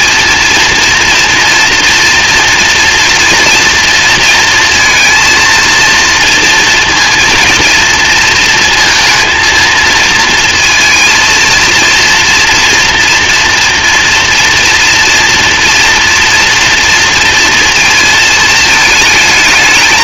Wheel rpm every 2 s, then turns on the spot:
230, 230, 230, 230, 230, 220, 230, 230, 230, 220.
none